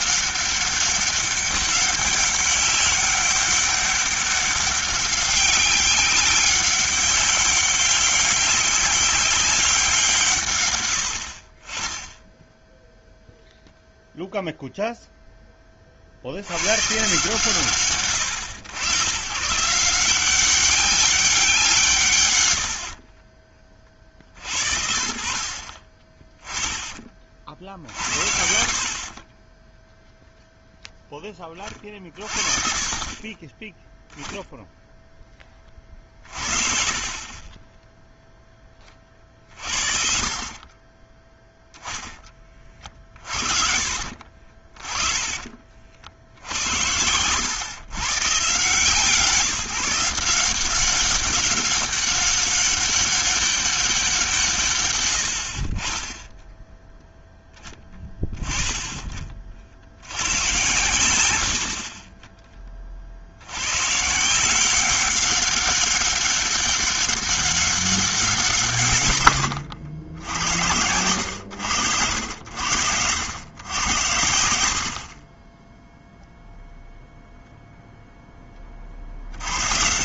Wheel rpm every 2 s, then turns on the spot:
200, 200, 200, 190, 190, 110, 0, 0, 110, 100, 190, 90, 60, 20, 60, 0, 40, 10, 40, 20, 30, 30, 40, 80, 150, 180, 200, 130, 10, 10, 90, 20, 180, 200, 160, 80, 80, 60, 0, 30.
42-46 74-76